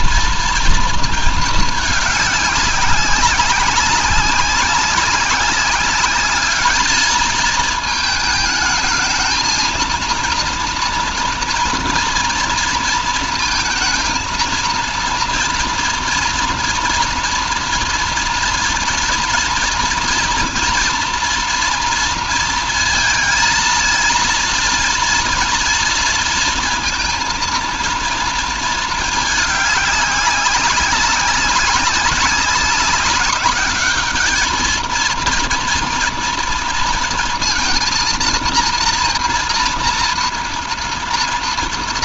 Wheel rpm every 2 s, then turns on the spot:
230, 200, 200, 220, 220, 230, 230, 230, 230, 230, 230, 230, 230, 230, 220, 190, 200, 220, 230, 230, 230.
none